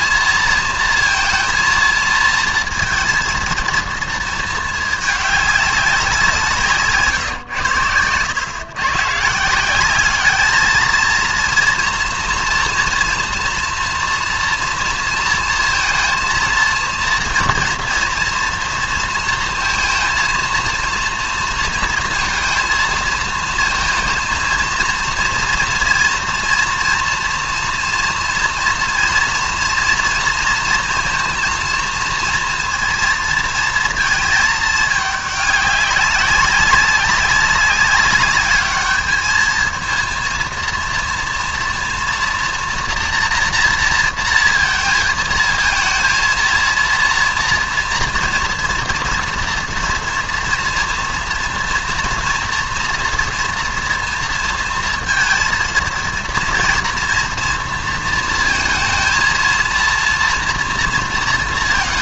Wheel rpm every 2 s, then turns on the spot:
230, 230, 220, 170, 120, 220, 230, 230, 230, 230, 230, 230, 230, 230, 230, 230, 230, 220, 200, 210, 230, 240, 220, 230, 230, 230, 230, 230, 230, 230, 240.
none